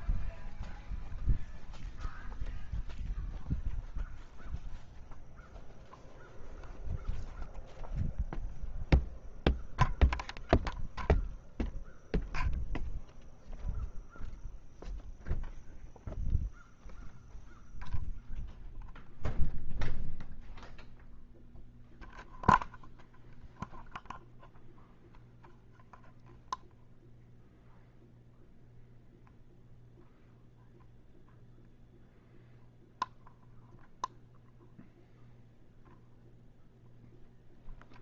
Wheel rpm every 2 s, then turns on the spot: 0, 0, 0, 0, 0, 0, 0, 0, 0, 0, 0, 0, 0, 0, 0, 0, 0, 0, 0.
none